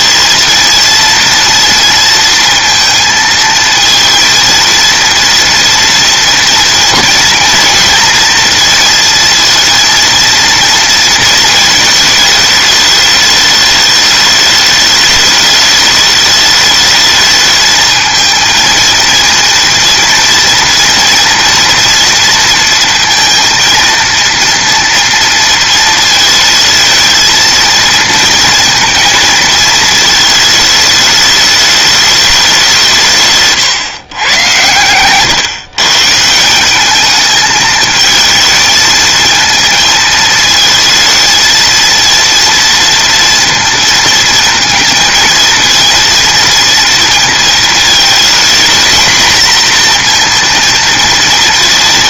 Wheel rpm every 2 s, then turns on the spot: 220, 230, 230, 230, 230, 230, 220, 210, 210, 220, 230, 230, 230, 220, 230, 220, 210, 120, 140, 220, 220, 230, 230, 230, 230, 240.
none